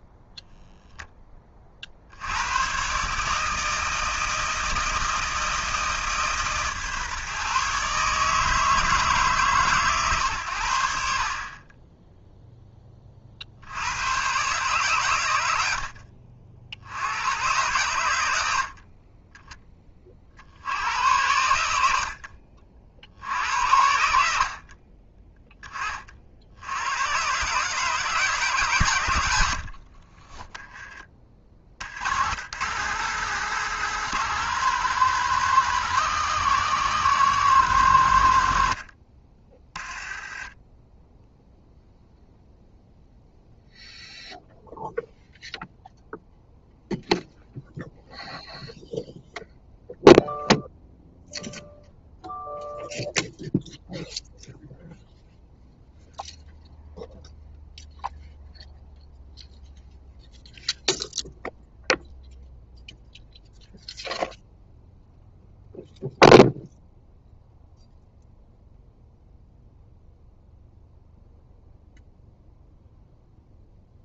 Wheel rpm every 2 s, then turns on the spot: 0, 120, 160, 140, 160, 80, 10, 130, 70, 60, 70, 60, 50, 80, 140, 10, 140, 170, 170, 80, 10, 0, 0, 0, 0, 0, 0, 0, 0, 0, 0, 0, 0, 0, 0, 0, 0.
none